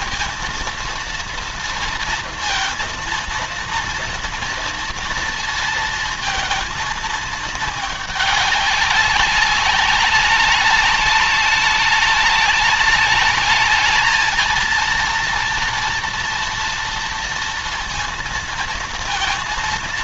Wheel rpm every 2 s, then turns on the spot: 230, 230, 230, 220, 200, 200, 210, 230, 230, 230.
none